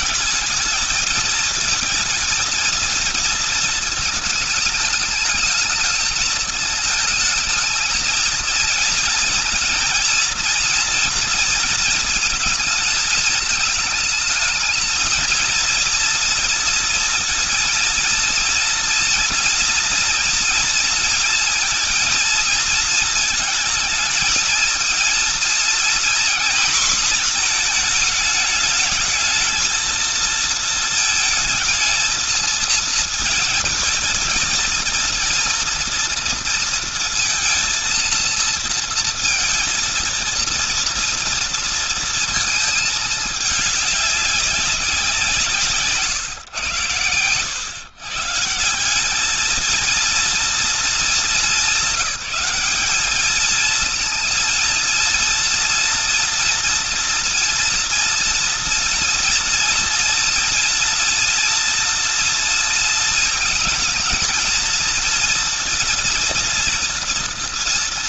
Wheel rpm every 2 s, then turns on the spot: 220, 220, 210, 220, 230, 240, 220, 220, 230, 230, 230, 230, 230, 230, 220, 220, 220, 230, 230, 230, 230, 220, 180, 120, 210, 220, 210, 230, 230, 230, 230, 230, 230, 230.
none